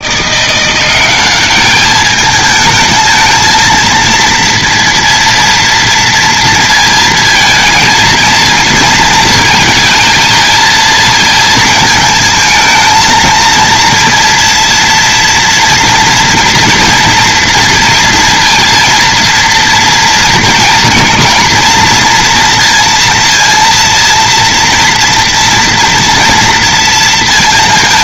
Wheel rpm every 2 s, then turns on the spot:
170, 210, 230, 230, 230, 230, 220, 230, 230, 230, 230, 230, 230, 230.
none